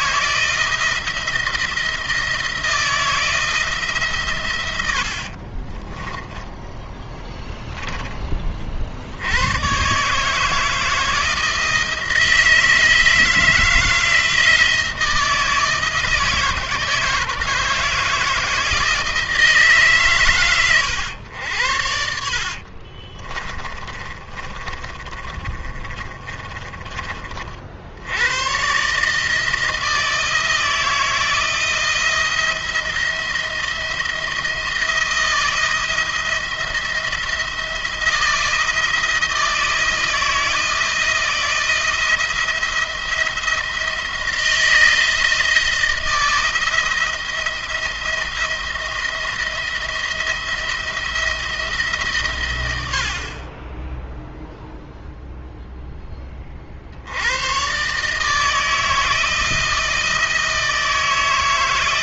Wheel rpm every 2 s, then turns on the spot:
170, 160, 110, 20, 40, 160, 160, 160, 160, 160, 110, 50, 40, 30, 120, 160, 170, 160, 170, 170, 160, 170, 160, 170, 170, 170, 100, 0, 40, 160, 160.
22-28